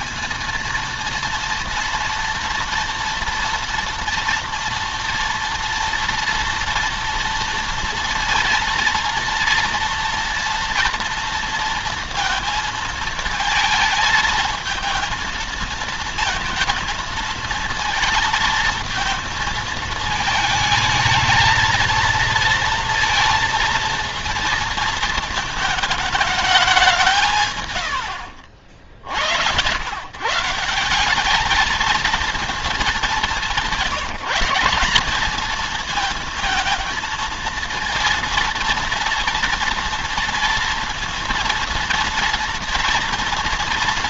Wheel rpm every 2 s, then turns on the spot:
230, 230, 230, 230, 230, 230, 220, 230, 220, 230, 220, 230, 230, 190, 50, 170, 220, 200, 230, 230, 230, 240.
none